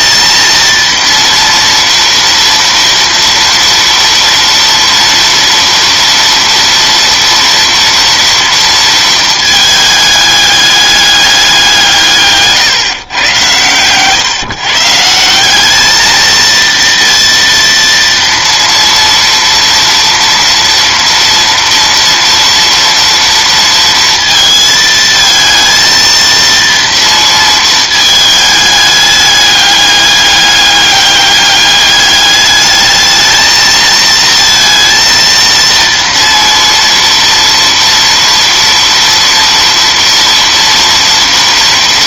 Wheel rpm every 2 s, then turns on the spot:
230, 240, 230, 230, 230, 210, 140, 140, 230, 230, 230, 230, 230, 230, 210, 200, 210, 230, 230, 240, 230.
none